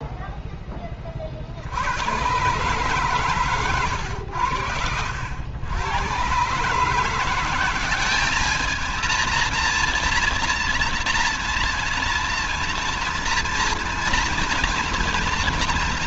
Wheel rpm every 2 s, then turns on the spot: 0, 120, 100, 120, 210, 230, 230, 240.
none